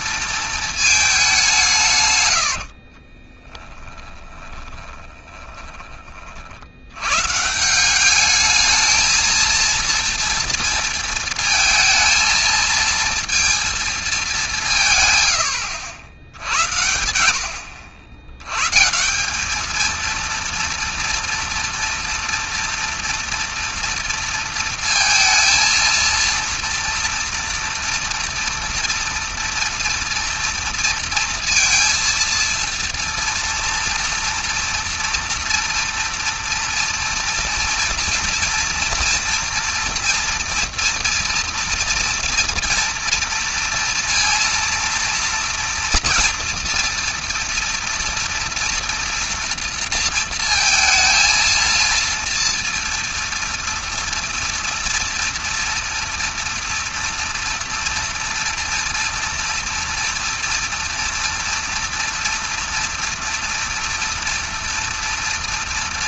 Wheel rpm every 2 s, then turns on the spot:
220, 60, 20, 80, 210, 230, 230, 160, 80, 140, 230, 230, 230, 230, 230, 230, 230, 230, 230, 230, 230, 230, 230, 230, 230, 230, 230, 230, 230, 230, 230, 240, 230.
2-6